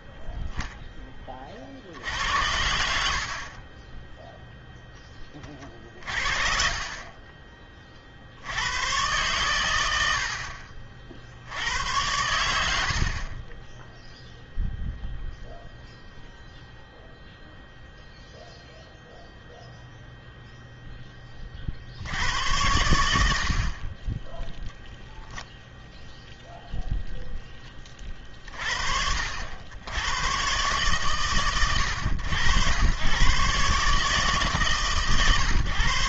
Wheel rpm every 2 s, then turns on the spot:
0, 80, 0, 40, 100, 50, 80, 0, 0, 0, 0, 100, 0, 0, 50, 130, 90, 130.
none